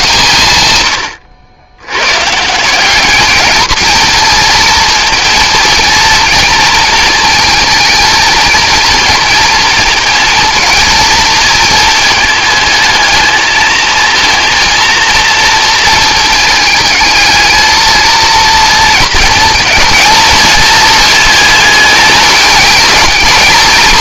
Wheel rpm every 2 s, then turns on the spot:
90, 200, 220, 230, 230, 230, 220, 230, 220, 230, 230, 220.
none